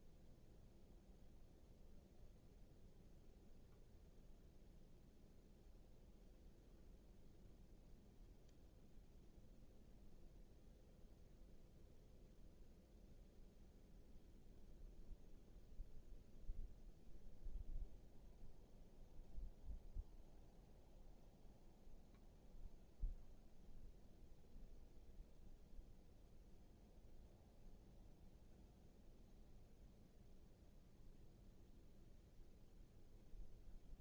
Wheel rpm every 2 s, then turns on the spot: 0, 0, 0, 0, 0, 0, 0, 0, 0, 0, 0, 0, 0, 0, 0, 0, 0.
none